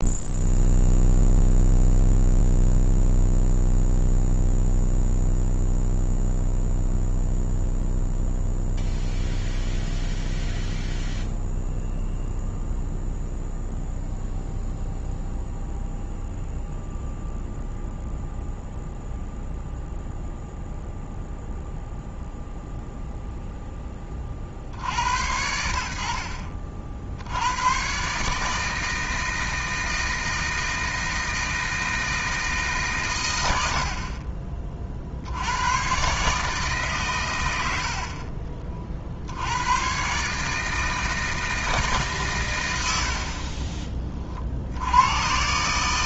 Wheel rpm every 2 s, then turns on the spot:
0, 0, 0, 0, 0, 0, 0, 0, 0, 0, 0, 0, 60, 50, 160, 160, 150, 40, 150, 40, 160, 100, 80.
none